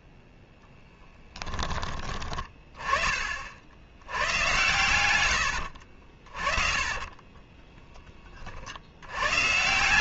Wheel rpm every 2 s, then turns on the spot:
10, 40, 80, 20, 120.
4-8